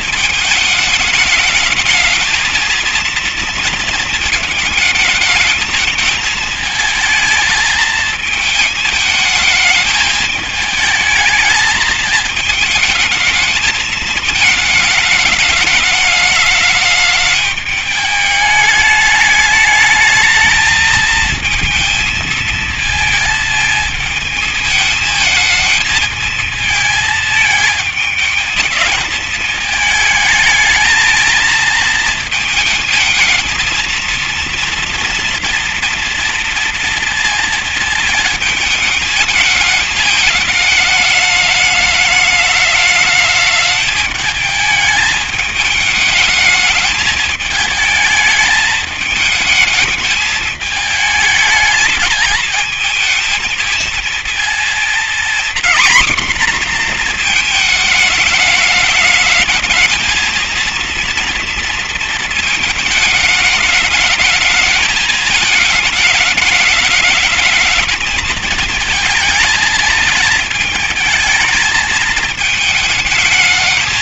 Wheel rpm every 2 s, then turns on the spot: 220, 220, 220, 220, 220, 220, 220, 220, 210, 210, 220, 220, 220, 220, 220, 220, 230, 240, 230, 220, 220, 210, 210, 220, 220, 220, 210, 230, 240, 220, 230, 220, 220, 210, 220, 220, 220.
none